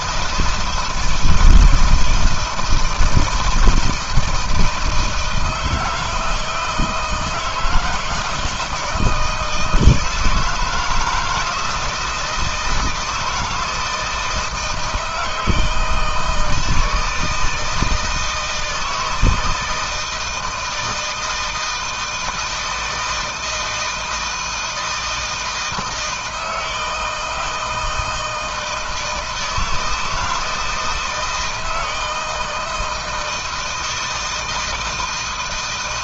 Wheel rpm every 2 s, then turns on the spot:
160, 170, 160, 160, 160, 160, 160, 160, 160, 160, 160, 160, 160, 160, 160, 160, 160, 160.
none